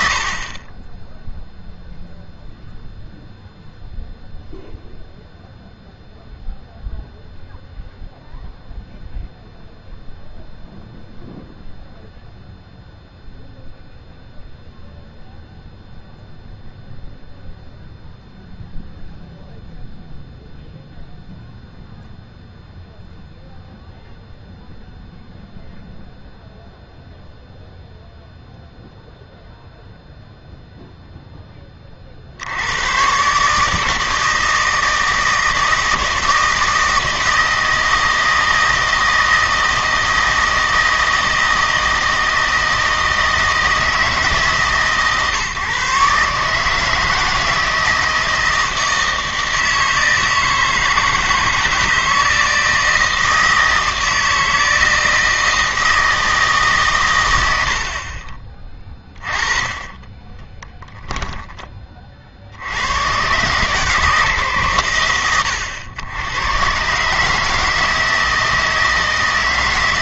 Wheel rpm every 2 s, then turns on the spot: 20, 0, 0, 0, 0, 0, 0, 0, 0, 0, 0, 0, 0, 0, 0, 0, 100, 160, 160, 160, 160, 160, 150, 150, 160, 160, 160, 160, 140, 20, 10, 90, 120, 120, 160.
60-62